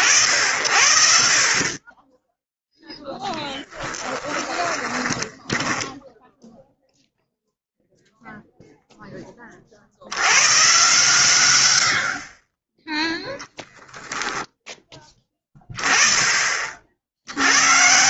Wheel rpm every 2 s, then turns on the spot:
50, 0, 20, 0, 0, 120, 10, 10, 60.
4-6